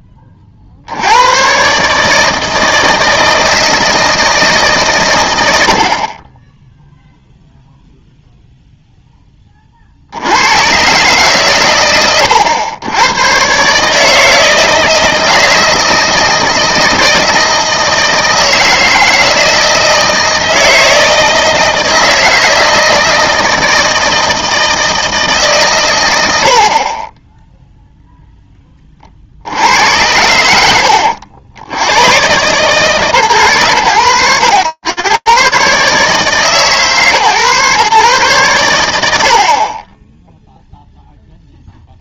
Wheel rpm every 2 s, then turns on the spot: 20, 160, 160, 20, 0, 120, 90, 160, 160, 160, 160, 160, 160, 70, 10, 90, 150, 120, 140, 60, 0.
none